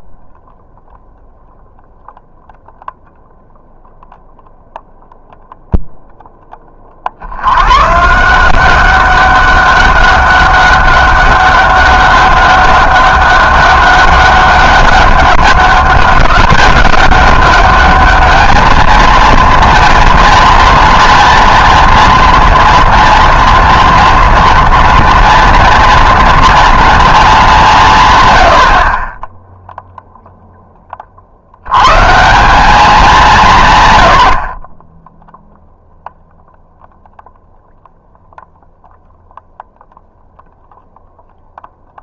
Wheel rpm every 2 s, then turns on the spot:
0, 0, 0, 30, 190, 200, 200, 200, 190, 220, 230, 230, 230, 230, 70, 10, 190, 40, 0, 0, 0.
none